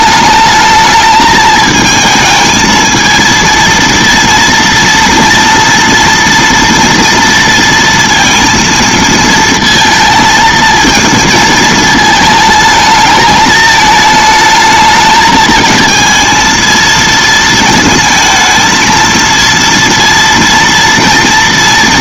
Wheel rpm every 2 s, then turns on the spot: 210, 220, 230, 230, 230, 220, 220, 220, 230, 230, 230.
none